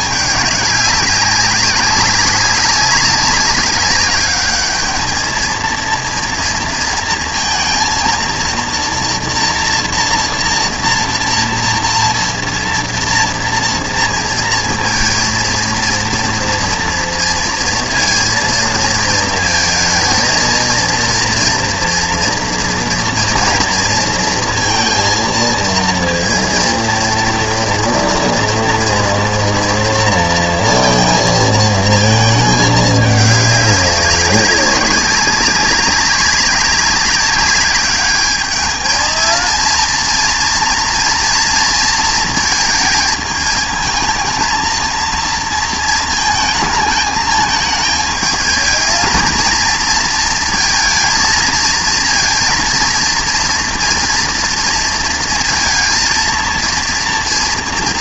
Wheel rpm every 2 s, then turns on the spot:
200, 200, 210, 230, 230, 230, 230, 230, 230, 230, 220, 230, 230, 230, 230, 230, 220, 190, 190, 210, 230, 220, 230, 220, 220, 230, 230, 230, 230.
none